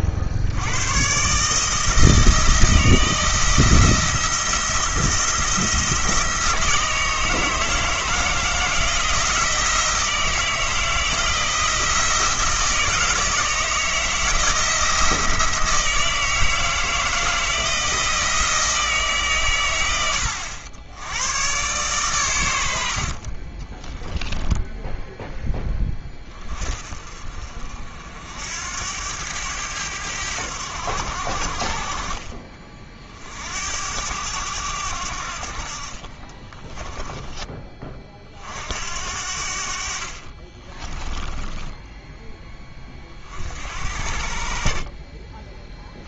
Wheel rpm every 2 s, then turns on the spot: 80, 160, 170, 160, 160, 160, 160, 170, 160, 160, 90, 90, 10, 30, 80, 90, 40, 90, 20, 60, 30, 10, 50.
36-38 40-42